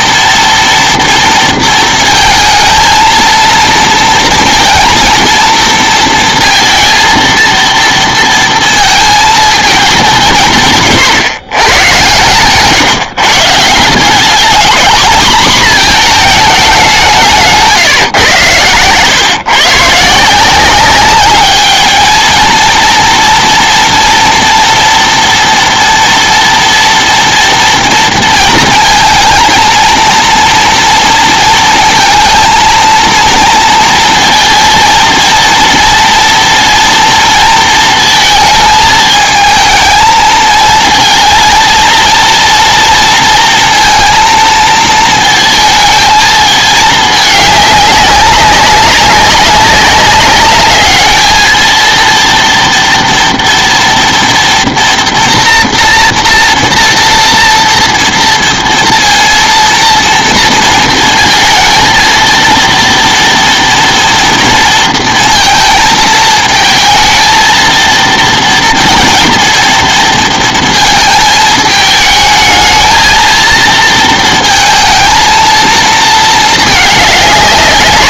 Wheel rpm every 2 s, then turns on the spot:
230, 220, 230, 230, 230, 160, 150, 220, 200, 120, 180, 230, 240, 240, 230, 230, 230, 230, 240, 220, 230, 230, 220, 220, 200, 210, 230, 240, 230, 230, 230, 230, 230, 220, 230, 230, 220, 220, 210.
none